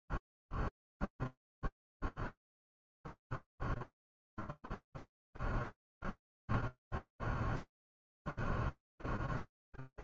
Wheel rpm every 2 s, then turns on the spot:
0, 0, 0, 0, 0.
none